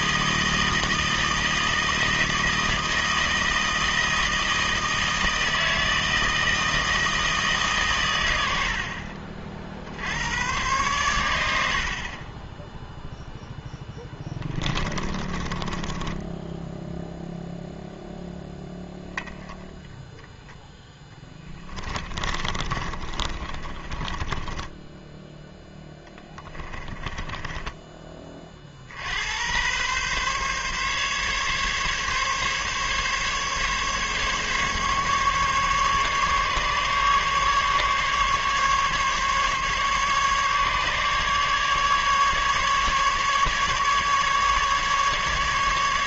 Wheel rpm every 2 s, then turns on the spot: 160, 160, 160, 160, 70, 100, 10, 20, 0, 0, 0, 30, 20, 20, 50, 140, 140, 140, 140, 140, 140, 140, 150.
14-16 22-28